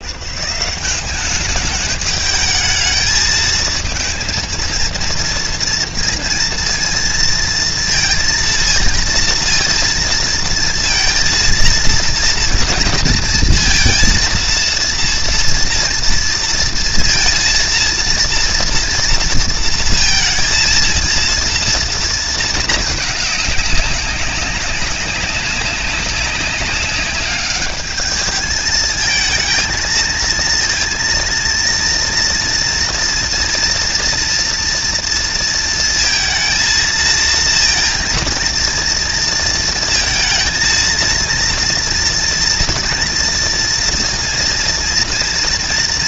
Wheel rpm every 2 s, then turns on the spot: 180, 220, 230, 230, 230, 230, 230, 230, 230, 230, 230, 220, 190, 200, 220, 230, 230, 230, 230, 230, 230, 230, 230.
none